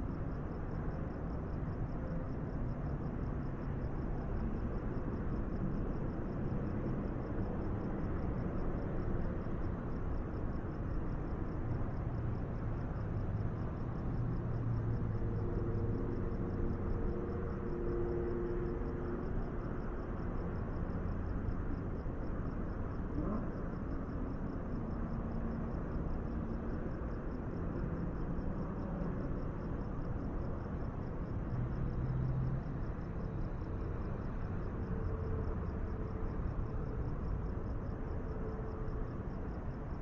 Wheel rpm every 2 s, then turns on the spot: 0, 0, 0, 0, 0, 0, 0, 0, 0, 0, 0, 0, 0, 0, 0, 0, 0, 0, 0, 0.
none